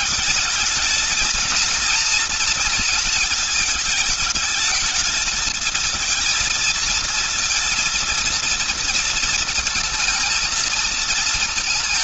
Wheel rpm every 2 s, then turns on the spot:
220, 230, 220, 230, 230, 230.
none